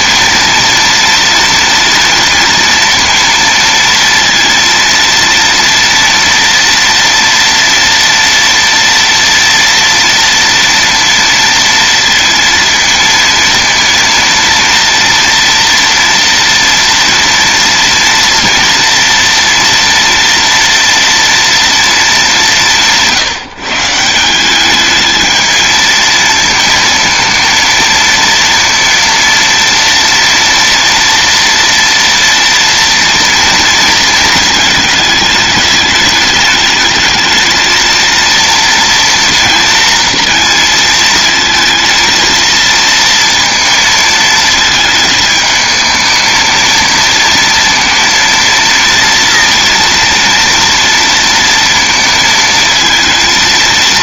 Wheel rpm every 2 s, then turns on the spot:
230, 230, 230, 230, 240, 230, 230, 230, 230, 230, 230, 190, 180, 230, 230, 230, 230, 220, 210, 230, 230, 230, 220, 220, 230, 230, 230.
none